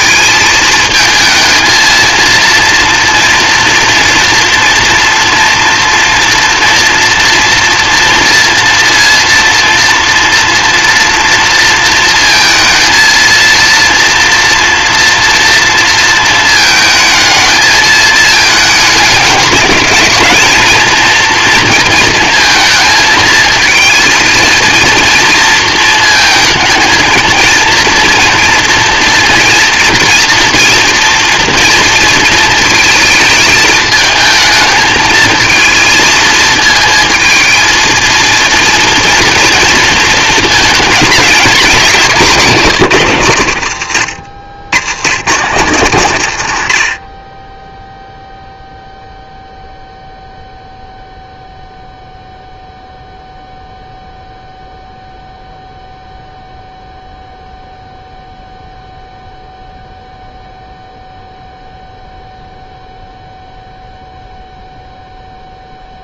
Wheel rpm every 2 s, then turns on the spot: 220, 230, 230, 230, 230, 230, 230, 240, 230, 210, 220, 230, 230, 220, 230, 230, 220, 220, 230, 230, 230, 190, 100, 110, 0, 0, 0, 0, 0, 0, 0, 0, 0.
42-44